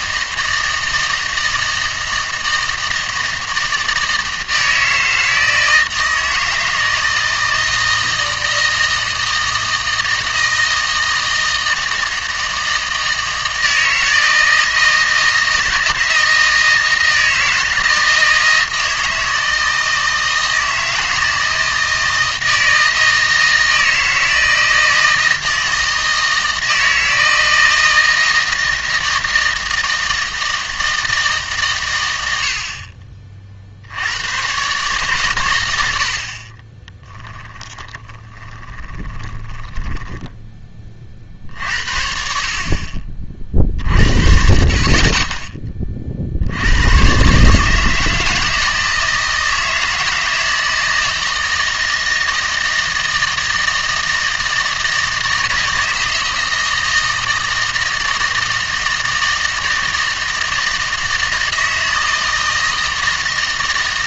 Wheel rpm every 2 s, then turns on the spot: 160, 160, 160, 160, 160, 160, 160, 160, 160, 160, 160, 160, 160, 160, 160, 160, 40, 130, 20, 20, 30, 40, 40, 100, 160, 160, 160, 160, 160, 160, 160, 160.
36-40